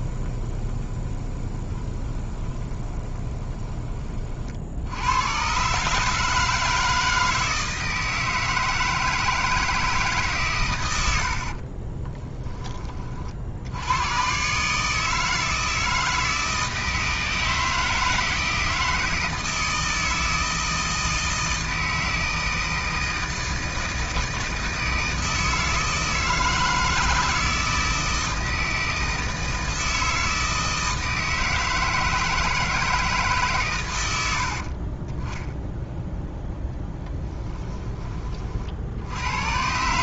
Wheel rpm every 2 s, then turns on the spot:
20, 20, 60, 160, 160, 130, 20, 140, 160, 160, 160, 160, 160, 160, 160, 160, 160, 70, 0, 50.
0-4